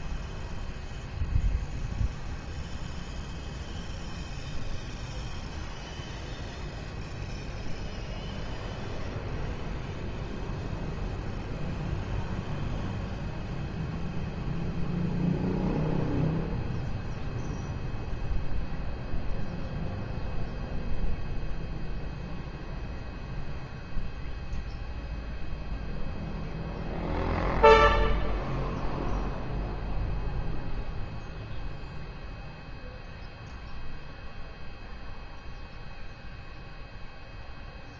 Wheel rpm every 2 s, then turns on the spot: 0, 0, 0, 0, 0, 0, 0, 0, 0, 0, 0, 0, 0, 0, 0, 0, 0, 0, 0.
none